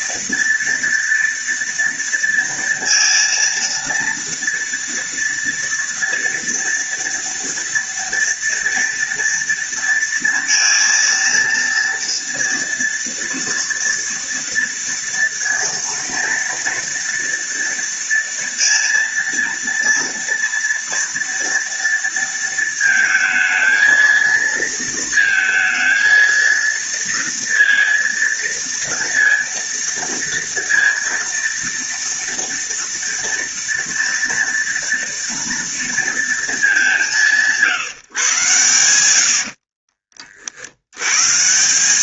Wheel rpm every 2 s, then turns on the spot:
230, 230, 230, 230, 230, 230, 230, 230, 230, 230, 230, 230, 230, 230, 230, 230, 230, 230, 190, 100, 70.
none